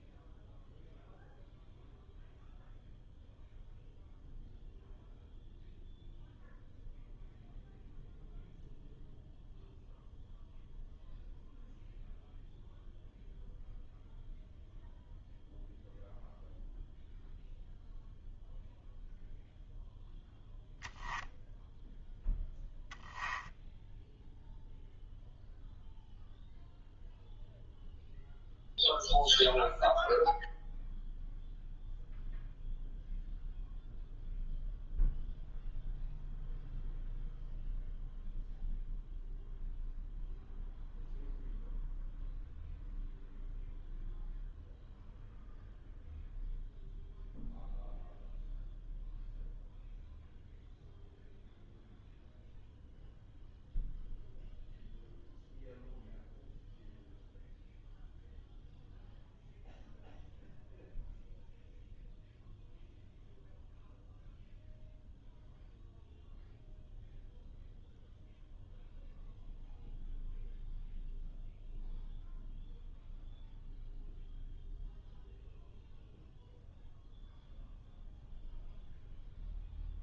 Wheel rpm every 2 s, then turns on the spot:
0, 0, 0, 0, 0, 0, 0, 0, 0, 0, 0, 0, 0, 0, 0, 0, 0, 0, 0, 0, 0, 0, 0, 0, 0, 0, 0, 0, 0, 0, 0, 0, 0, 0, 0, 0, 0, 0, 0, 0.
none